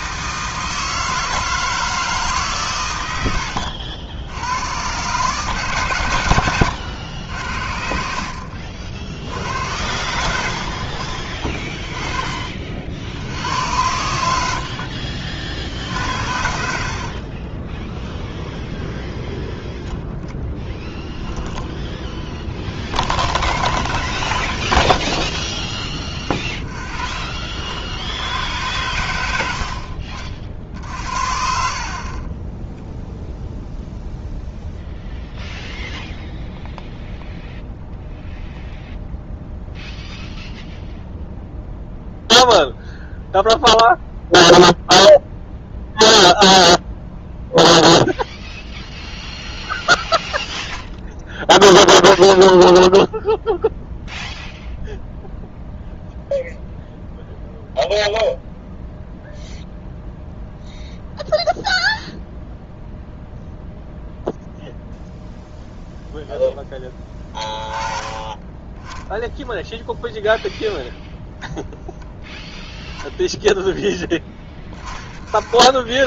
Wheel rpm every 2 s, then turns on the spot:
160, 110, 110, 80, 60, 40, 70, 50, 60, 0, 0, 0, 0, 30, 100, 60, 0, 0, 0, 0, 0, 0, 0, 0, 0, 0, 0, 0, 0, 0, 0, 0, 0, 10, 10, 0, 0, 20.
none